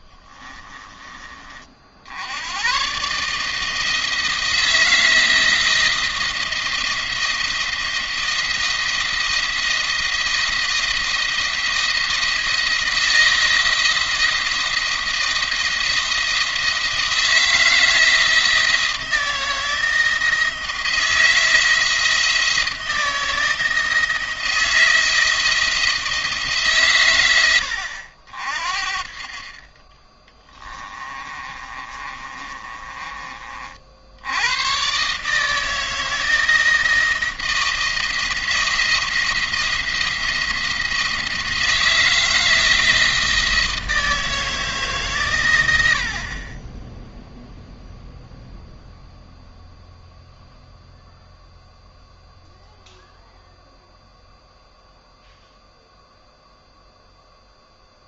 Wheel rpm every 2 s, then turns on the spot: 20, 130, 170, 170, 170, 170, 170, 170, 170, 160, 160, 160, 160, 120, 50, 20, 30, 120, 170, 170, 170, 160, 140, 10, 0, 0, 0, 0, 0.
30-34